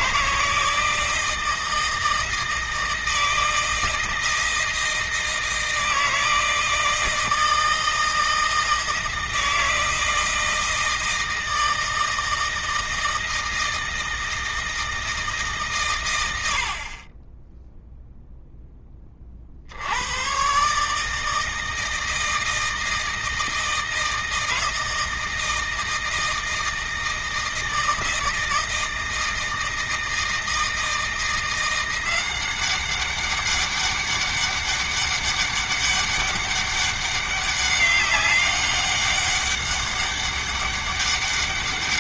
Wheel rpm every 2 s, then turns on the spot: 160, 160, 160, 160, 160, 160, 160, 160, 40, 20, 150, 160, 160, 160, 160, 170, 190, 200, 200, 200, 200.
none